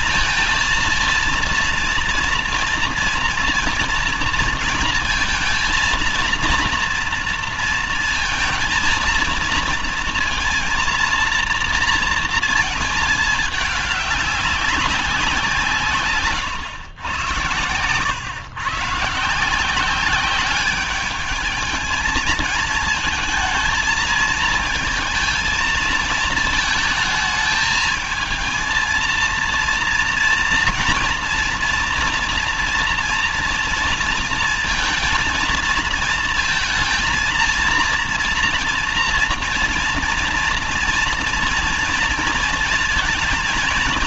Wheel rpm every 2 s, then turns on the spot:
230, 230, 230, 230, 230, 230, 220, 200, 110, 120, 200, 220, 220, 220, 220, 230, 240, 230, 230, 230, 240, 230.
none